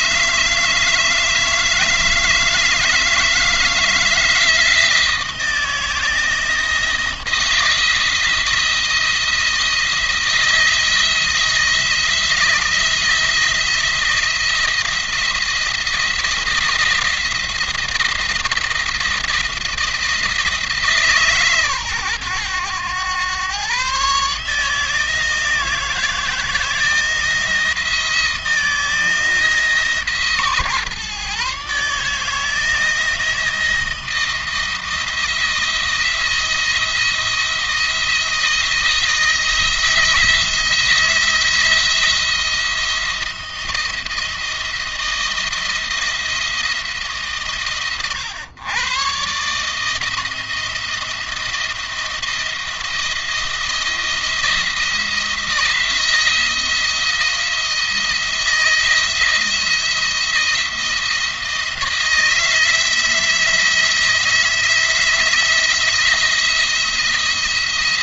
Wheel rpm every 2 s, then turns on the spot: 160, 160, 160, 170, 160, 170, 170, 170, 170, 170, 160, 100, 160, 160, 160, 140, 160, 160, 160, 160, 170, 170, 170, 160, 120, 170, 170, 170, 160, 170, 170, 160, 170, 170.
none